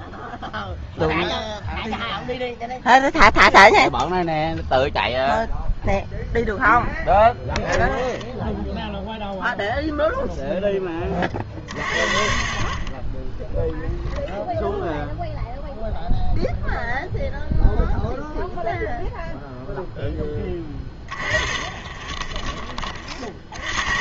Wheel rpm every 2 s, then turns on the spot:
0, 0, 0, 0, 0, 0, 30, 0, 0, 0, 10, 30.
none